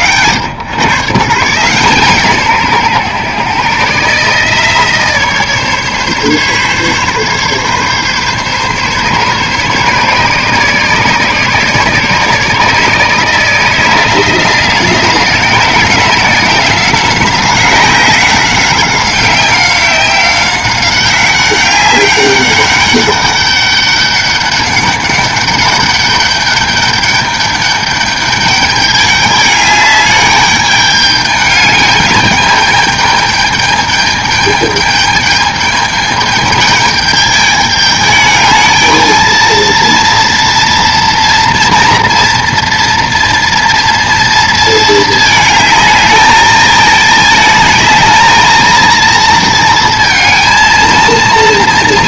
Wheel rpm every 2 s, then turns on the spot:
140, 130, 150, 140, 140, 150, 160, 170, 180, 190, 190, 200, 200, 200, 210, 210, 210, 210, 210, 220, 230, 230, 220, 220, 230, 230.
none